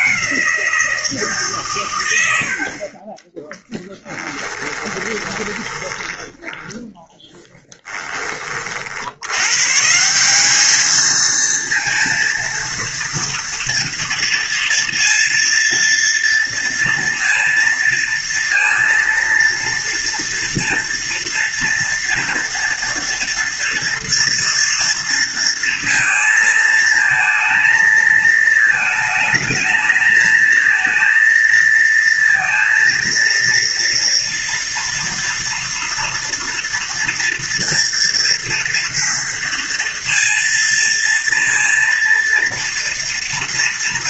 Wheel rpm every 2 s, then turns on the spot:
160, 30, 20, 10, 80, 220, 230, 230, 230, 230, 230, 230, 230, 220, 220, 230, 230, 230, 230, 230, 230, 230.
4-8